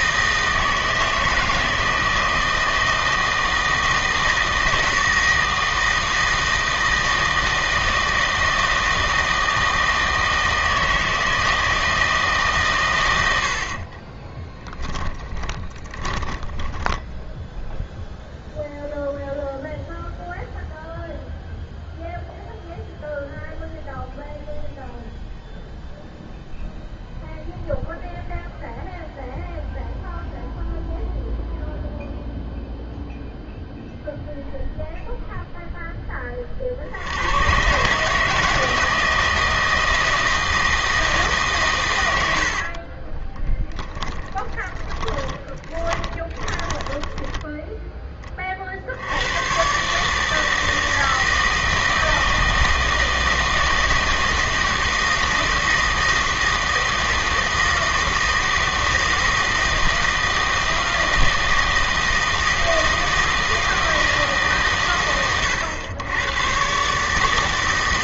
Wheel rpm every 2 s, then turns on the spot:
160, 160, 160, 160, 160, 160, 130, 10, 10, 0, 0, 0, 0, 0, 0, 0, 0, 0, 60, 160, 160, 50, 10, 10, 50, 160, 160, 160, 160, 160, 160, 160, 140, 120.
14-18 42-48